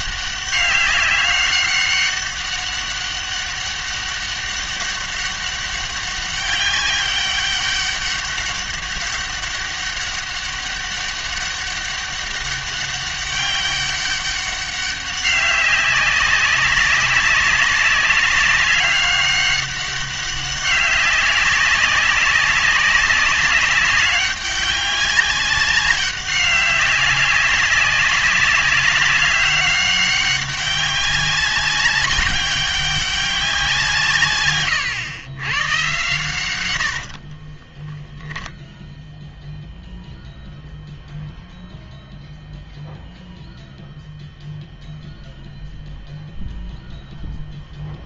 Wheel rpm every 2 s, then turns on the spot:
200, 200, 200, 200, 200, 200, 200, 200, 200, 200, 200, 190, 200, 200, 200, 190, 200, 120, 100, 0, 0, 0, 0, 0.
none